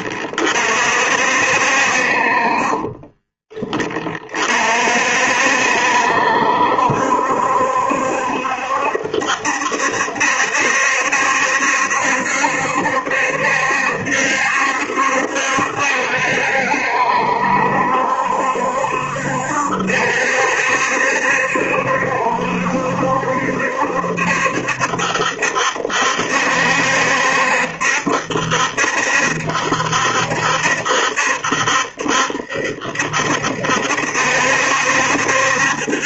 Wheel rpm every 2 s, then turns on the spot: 60, 30, 50, 70, 70, 70, 70, 70, 70, 70, 70, 70, 70, 70, 70, 70, 70, 70.
2-4